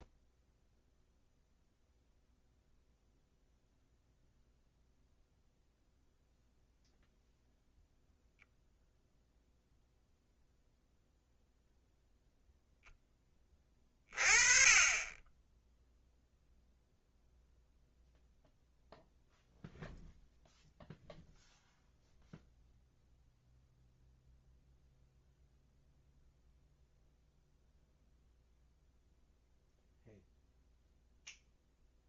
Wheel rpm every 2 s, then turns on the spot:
0, 0, 0, 0, 0, 0, 0, 30, 0, 0, 0, 0, 0, 0, 0, 0.
none